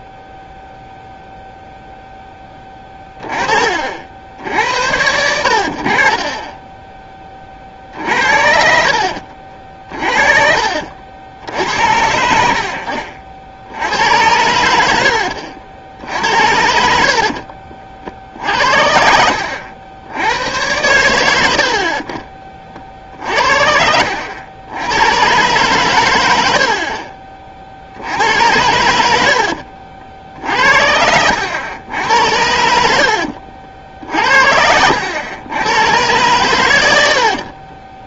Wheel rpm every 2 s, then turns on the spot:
0, 10, 70, 20, 60, 60, 70, 80, 60, 70, 100, 30, 90, 80, 90, 80, 80, 70, 100.
10-12 16-18 26-28 32-34